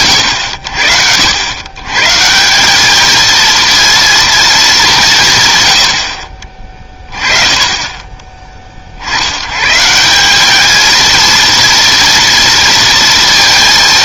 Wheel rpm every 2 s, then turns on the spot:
100, 170, 220, 30, 30, 200, 230.
none